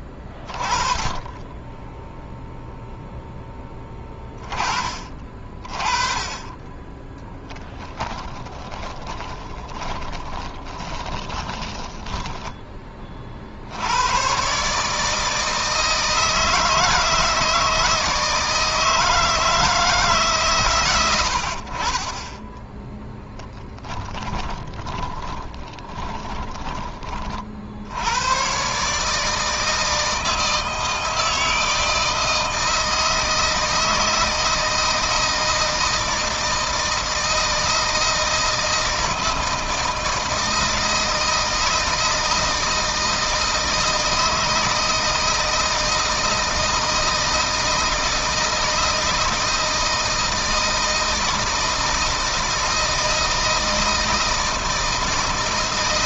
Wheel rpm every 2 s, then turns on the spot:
20, 0, 30, 10, 20, 20, 20, 150, 170, 160, 120, 10, 20, 20, 130, 160, 160, 160, 160, 160, 160, 160, 160, 160, 160, 160, 160, 160.
8-12 24-26